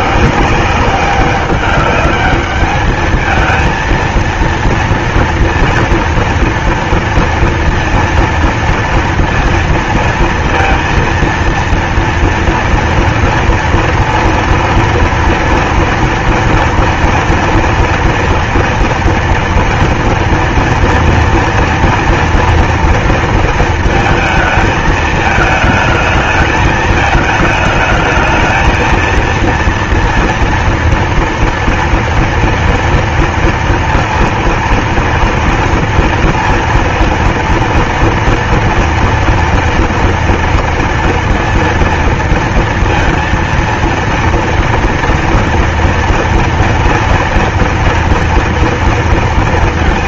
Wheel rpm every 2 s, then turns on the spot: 170, 210, 230, 230, 230, 230, 230, 230, 230, 230, 230, 230, 230, 220, 220, 230, 230, 230, 230, 230, 240, 230, 230, 230, 230.
none